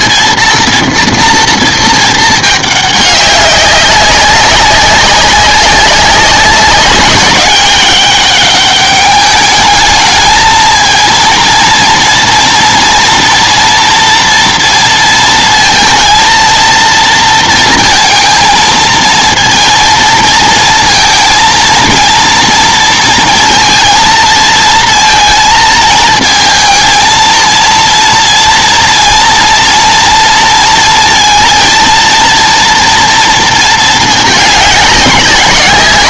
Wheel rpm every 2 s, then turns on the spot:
240, 210, 190, 190, 200, 220, 240, 230, 230, 230, 230, 230, 230, 230, 230, 230, 230, 210.
none